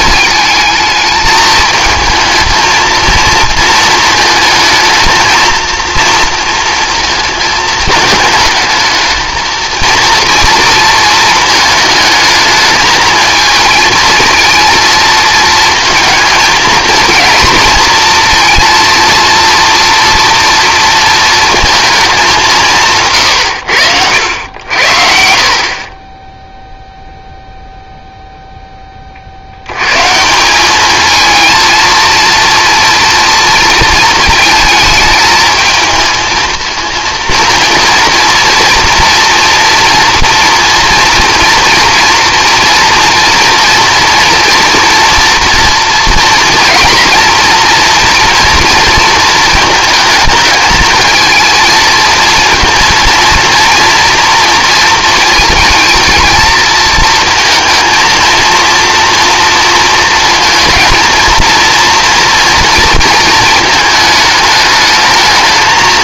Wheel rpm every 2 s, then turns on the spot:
220, 230, 220, 230, 220, 230, 220, 230, 230, 230, 230, 170, 70, 0, 20, 210, 230, 220, 230, 230, 230, 240, 230, 230, 230, 220, 230, 230, 230, 230, 230, 230, 220.
none